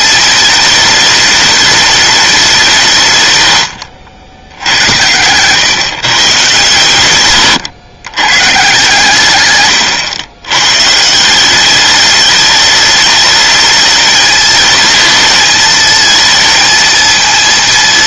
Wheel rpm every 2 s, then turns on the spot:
220, 180, 90, 130, 130, 140, 210, 220, 230.
none